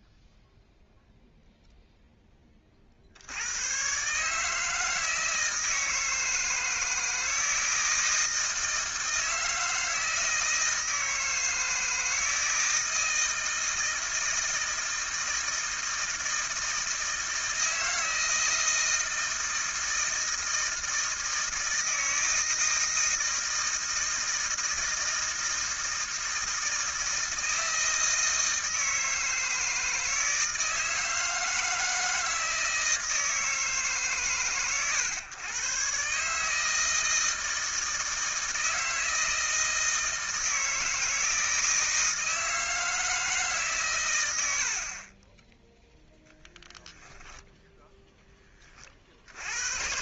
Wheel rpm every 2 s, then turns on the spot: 0, 0, 120, 160, 160, 160, 160, 160, 160, 160, 160, 160, 160, 160, 160, 160, 160, 130, 160, 160, 160, 160, 40, 10, 30.
none